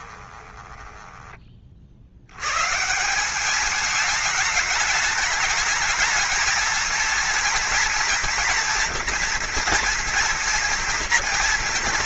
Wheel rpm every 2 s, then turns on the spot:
20, 160, 210, 230, 240, 240.
0-2